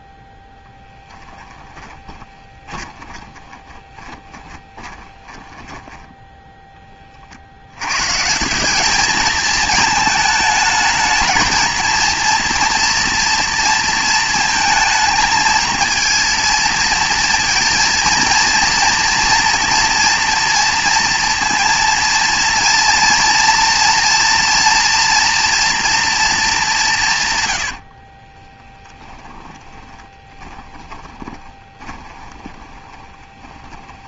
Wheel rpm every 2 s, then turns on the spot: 0, 20, 20, 10, 170, 220, 230, 230, 230, 230, 230, 230, 230, 210, 20, 20, 20.
2-6 28-34